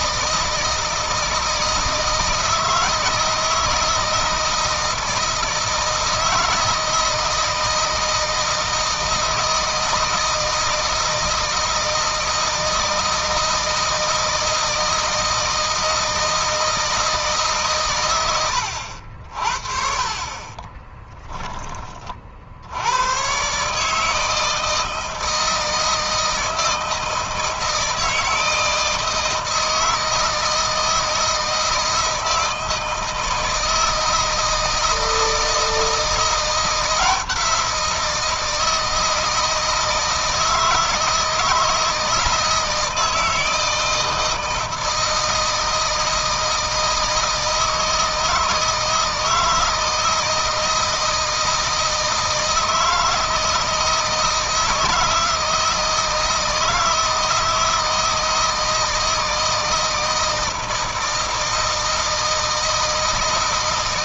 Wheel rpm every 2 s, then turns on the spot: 160, 160, 160, 160, 160, 160, 160, 160, 160, 70, 10, 90, 160, 160, 160, 160, 160, 160, 170, 160, 160, 160, 160, 160, 160, 160, 160, 160, 160, 160, 160, 160.
20-22